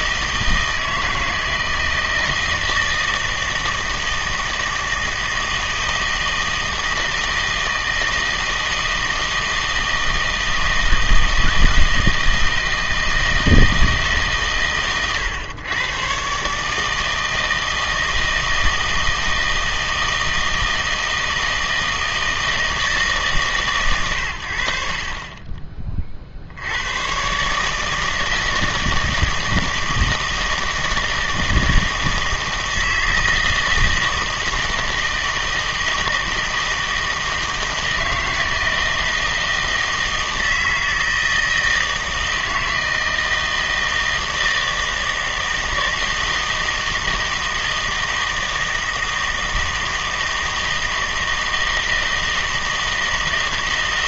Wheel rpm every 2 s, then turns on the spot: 160, 160, 160, 160, 160, 160, 160, 120, 150, 160, 160, 160, 60, 80, 160, 160, 160, 160, 160, 160, 160, 160, 160, 160, 160, 160, 160.
none